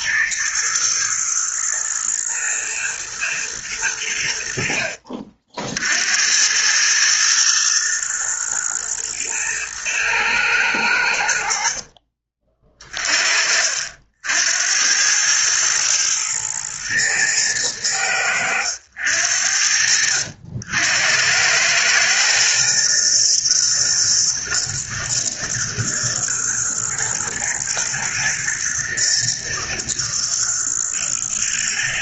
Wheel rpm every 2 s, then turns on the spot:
110, 120, 70, 100, 110, 100, 30, 80, 110, 90, 80, 120, 110, 110, 110, 110.
none